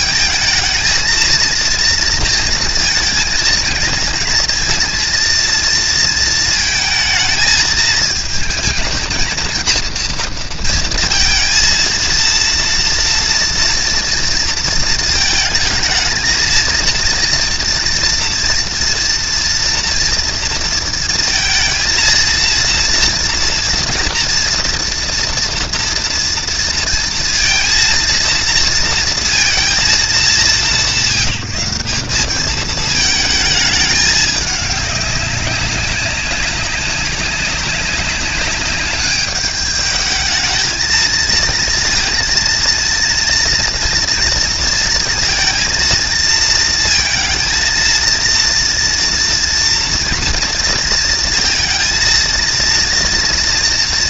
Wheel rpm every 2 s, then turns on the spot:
230, 230, 230, 220, 220, 230, 230, 220, 230, 230, 230, 230, 240, 230, 230, 180, 220, 200, 200, 200, 230, 230, 230, 220, 230, 230, 230.
none